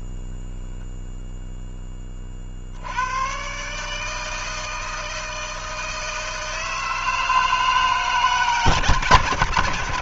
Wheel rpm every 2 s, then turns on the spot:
0, 70, 160, 160, 150.
none